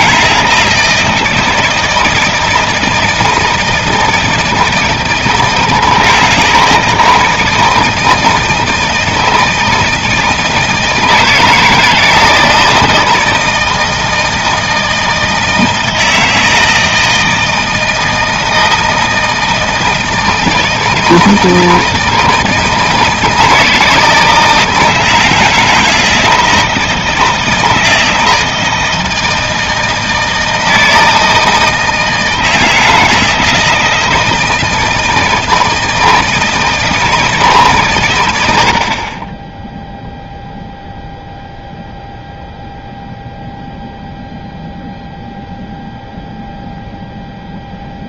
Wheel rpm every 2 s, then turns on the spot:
160, 160, 160, 160, 160, 160, 160, 160, 160, 160, 160, 160, 160, 170, 160, 160, 160, 160, 160, 80, 0, 0, 0, 0.
none